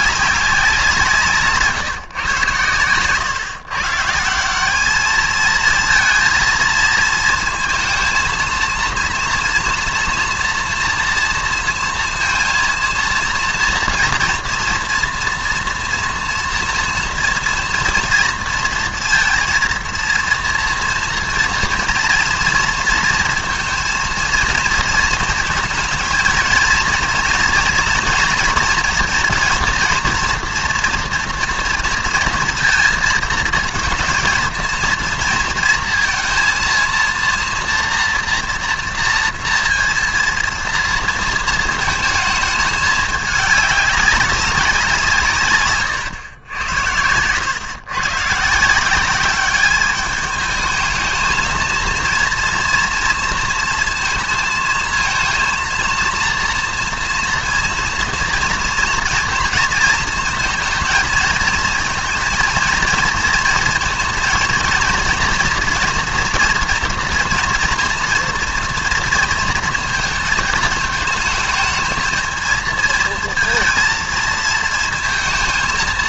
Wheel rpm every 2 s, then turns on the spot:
190, 120, 190, 230, 230, 230, 230, 230, 240, 230, 230, 230, 230, 220, 240, 240, 230, 230, 230, 230, 230, 220, 190, 100, 150, 210, 230, 230, 240, 230, 230, 230, 230, 240, 230, 220, 220, 230.
none